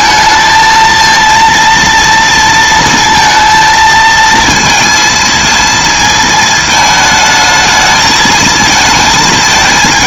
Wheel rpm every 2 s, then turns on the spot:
220, 230, 230, 220, 220.
none